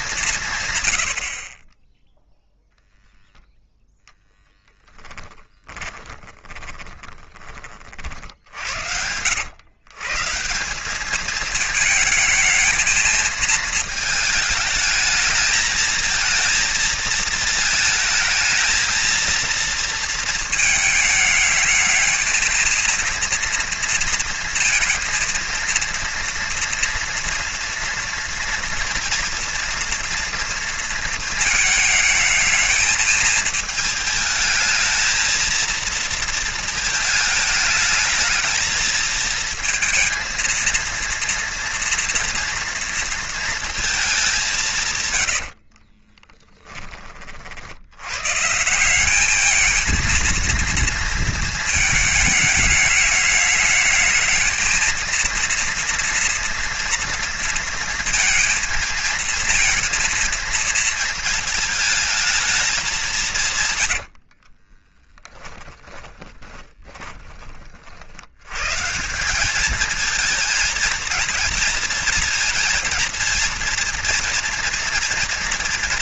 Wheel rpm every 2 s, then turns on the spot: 120, 0, 10, 20, 80, 180, 220, 210, 220, 220, 220, 230, 230, 230, 230, 230, 220, 220, 220, 220, 230, 230, 170, 20, 180, 230, 220, 220, 230, 230, 220, 210, 30, 20, 140, 230, 230, 230.
4-8 64-68